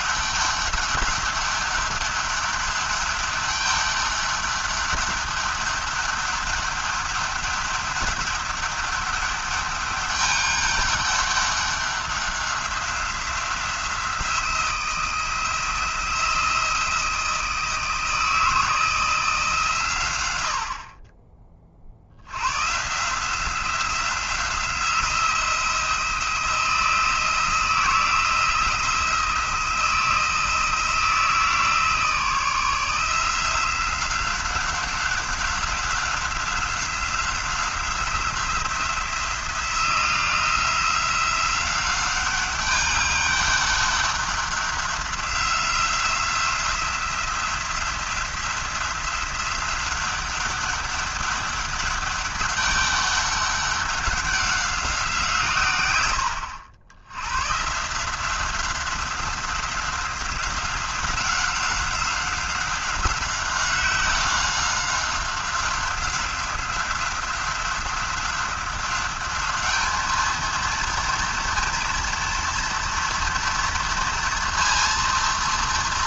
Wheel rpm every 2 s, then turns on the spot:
200, 200, 200, 200, 200, 200, 190, 170, 170, 160, 60, 130, 170, 170, 170, 160, 160, 190, 190, 180, 180, 200, 190, 180, 180, 200, 200, 190, 80, 190, 190, 190, 190, 180, 190, 230, 230, 230.
none